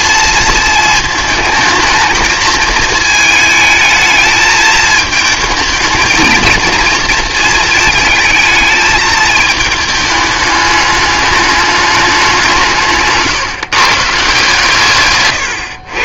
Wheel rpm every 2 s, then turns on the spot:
220, 220, 220, 220, 220, 210, 170, 150.
none